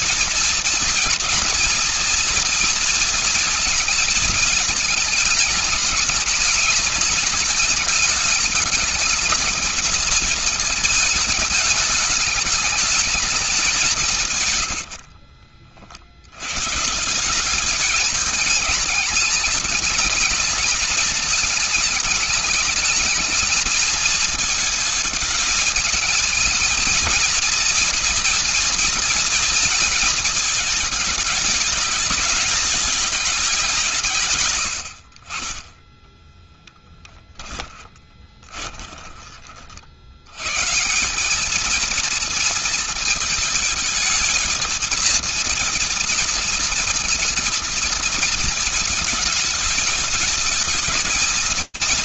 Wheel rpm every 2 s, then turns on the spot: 230, 230, 220, 220, 220, 230, 210, 160, 80, 210, 220, 220, 220, 220, 230, 230, 210, 160, 20, 20, 80, 230, 220, 230, 230, 210.
14-16 34-40